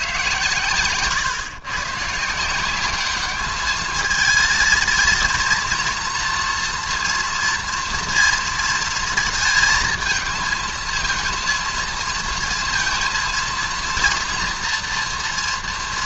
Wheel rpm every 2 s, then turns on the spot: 130, 190, 220, 230, 230, 220, 230, 240.
none